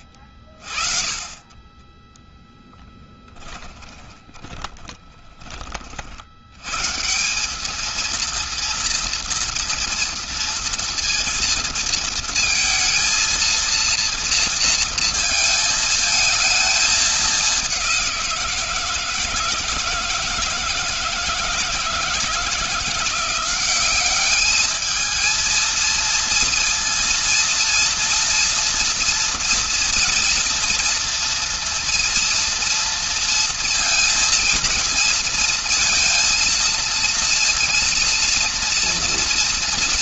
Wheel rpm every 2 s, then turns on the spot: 50, 10, 10, 90, 230, 230, 230, 230, 220, 170, 160, 170, 200, 230, 230, 240, 230, 230, 230, 230.
2-6